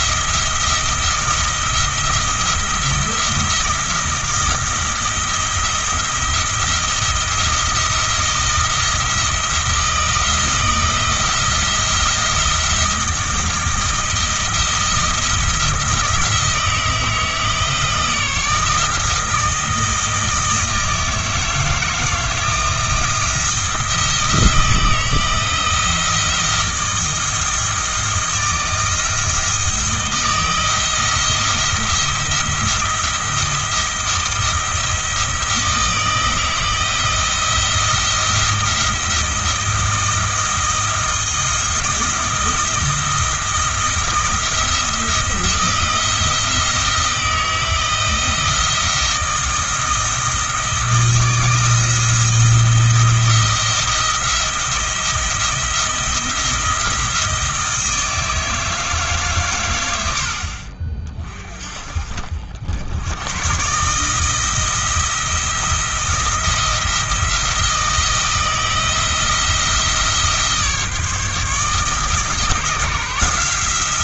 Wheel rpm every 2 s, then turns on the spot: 170, 170, 170, 160, 170, 170, 170, 170, 160, 160, 160, 160, 160, 170, 170, 160, 170, 160, 160, 170, 160, 170, 170, 170, 170, 160, 170, 170, 170, 160, 40, 90, 170, 170, 160, 150, 160.
none